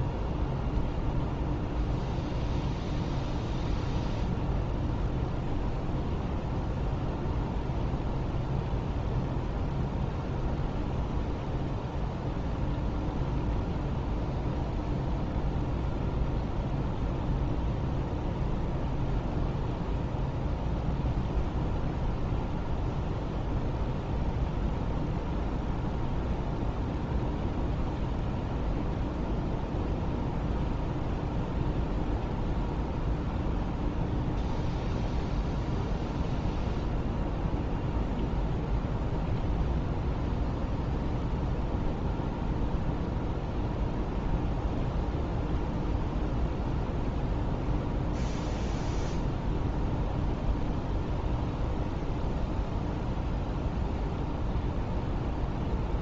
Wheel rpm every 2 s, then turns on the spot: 0, 0, 0, 0, 0, 0, 0, 0, 0, 0, 0, 0, 0, 0, 0, 0, 0, 0, 0, 0, 0, 0, 0, 0, 0, 0, 0, 0.
none